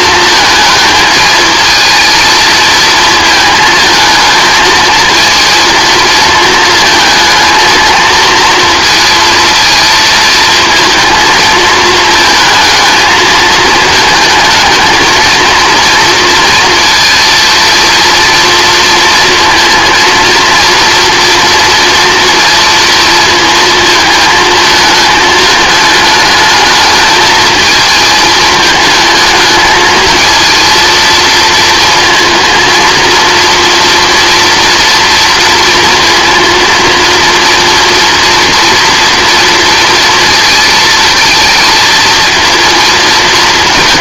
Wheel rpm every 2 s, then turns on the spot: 220, 230, 220, 220, 230, 220, 220, 220, 230, 230, 230, 230, 220, 210, 220, 230, 230, 230, 230, 230, 230, 220.
none